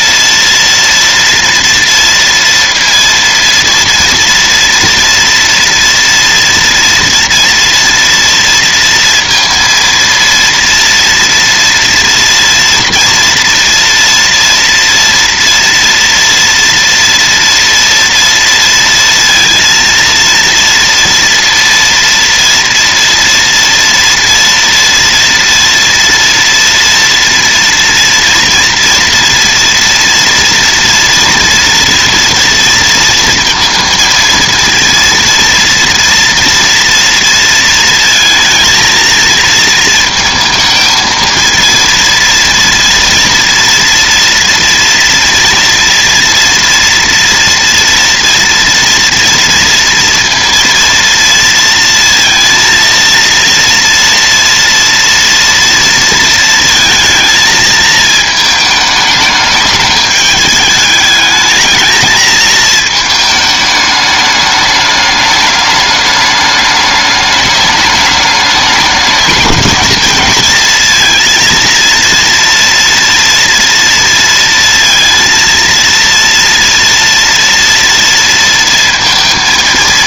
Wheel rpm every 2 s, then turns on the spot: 230, 230, 230, 230, 230, 230, 230, 230, 230, 230, 230, 230, 230, 240, 230, 230, 230, 230, 230, 230, 220, 230, 230, 230, 230, 230, 230, 230, 230, 220, 210, 220, 210, 210, 210, 230, 230, 230, 230, 230.
none